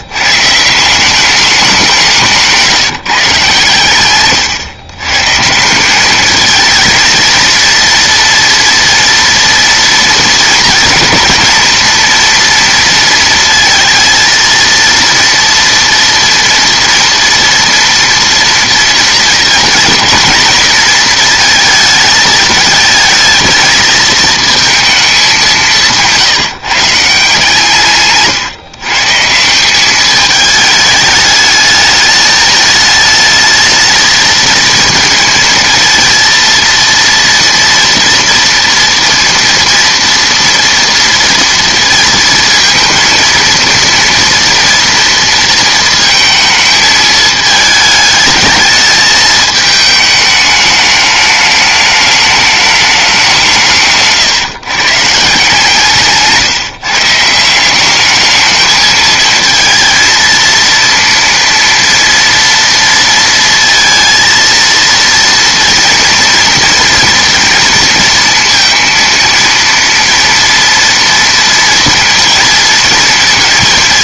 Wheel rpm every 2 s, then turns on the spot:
170, 160, 120, 220, 230, 240, 230, 230, 230, 230, 230, 220, 230, 150, 130, 210, 210, 230, 230, 230, 230, 220, 230, 220, 220, 210, 210, 140, 160, 220, 230, 230, 230, 230, 230, 230, 230.
none